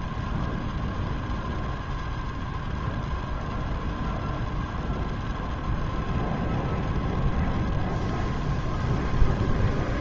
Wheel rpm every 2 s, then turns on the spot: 0, 0, 0, 0, 0.
none